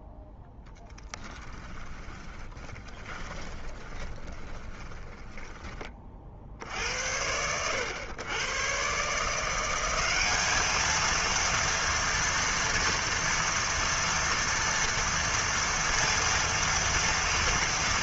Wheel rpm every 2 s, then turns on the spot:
0, 20, 20, 40, 100, 200, 230, 240, 230.
2-6